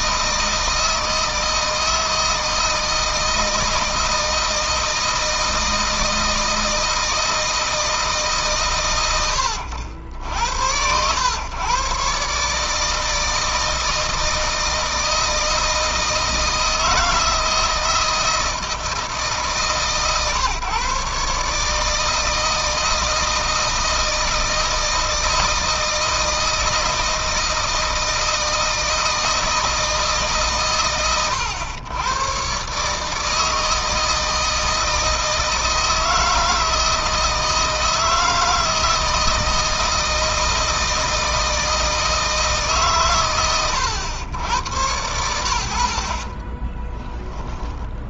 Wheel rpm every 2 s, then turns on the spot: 160, 160, 160, 160, 120, 90, 150, 160, 160, 160, 130, 160, 160, 160, 160, 140, 140, 160, 160, 160, 160, 130, 90, 30.
46-48